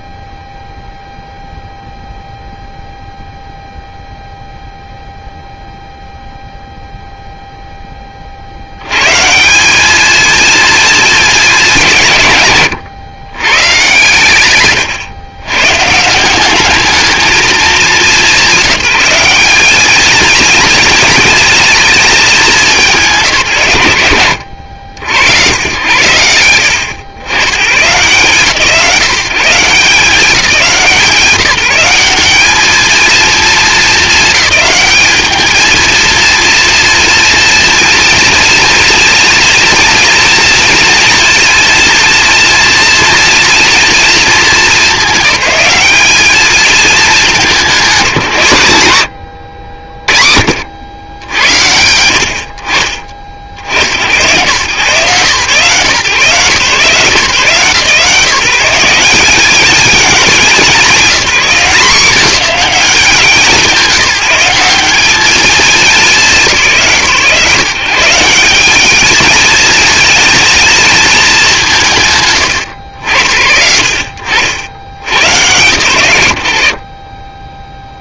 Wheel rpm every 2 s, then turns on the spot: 0, 0, 0, 0, 70, 220, 140, 120, 210, 190, 220, 170, 80, 100, 150, 170, 230, 200, 230, 230, 230, 230, 210, 210, 100, 60, 50, 120, 140, 190, 200, 190, 190, 150, 210, 220, 90, 70, 60.
none